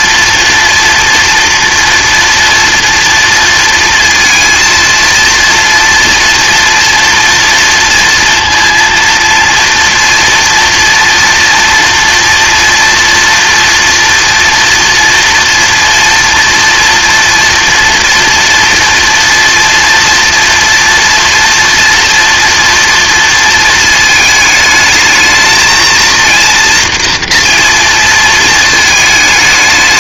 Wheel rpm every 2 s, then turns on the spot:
230, 240, 230, 230, 230, 230, 230, 230, 230, 230, 230, 230, 220, 230, 220.
none